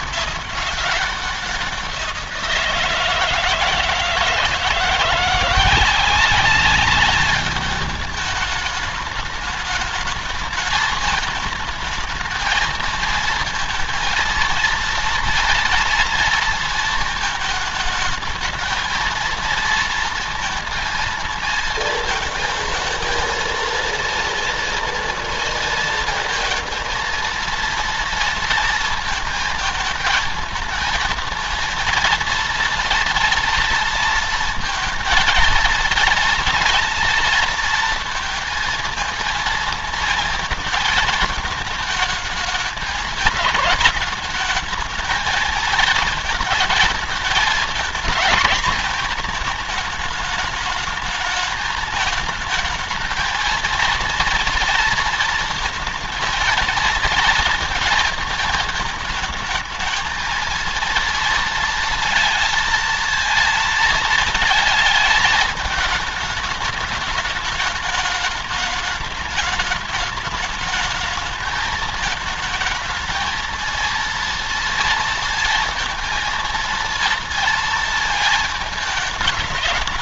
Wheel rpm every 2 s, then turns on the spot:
200, 170, 160, 200, 210, 220, 220, 230, 230, 220, 230, 230, 230, 230, 230, 220, 230, 230, 230, 230, 220, 210, 220, 230, 230, 220, 220, 230, 230, 220, 230, 230, 220, 210, 210, 210, 220, 230, 230, 220.
none